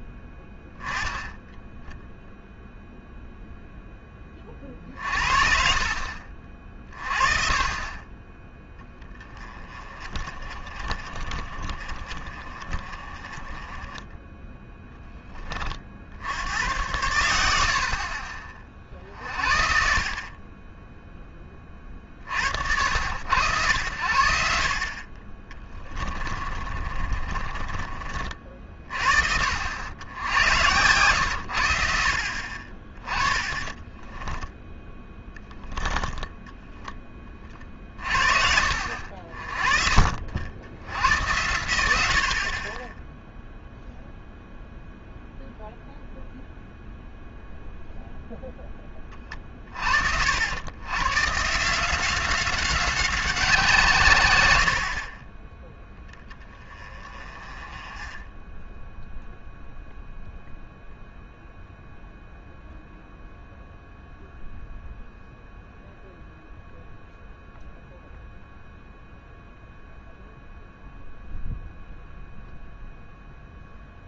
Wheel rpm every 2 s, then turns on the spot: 10, 0, 30, 40, 20, 40, 40, 10, 90, 40, 20, 60, 50, 30, 40, 100, 40, 10, 20, 60, 90, 30, 0, 0, 10, 110, 190, 80, 20, 10, 0, 0, 0, 0, 0, 0, 0.
26-28 58-60